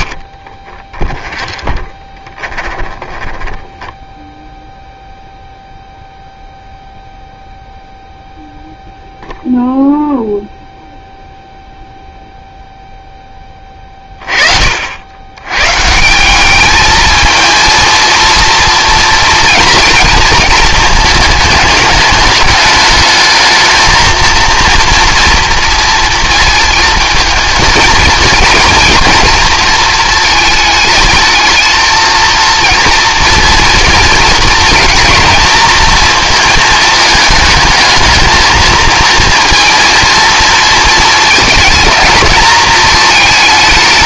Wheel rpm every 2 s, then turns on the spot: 20, 20, 0, 0, 0, 0, 0, 50, 200, 230, 220, 210, 230, 220, 220, 220, 230, 220, 220, 230, 230, 220.
0-4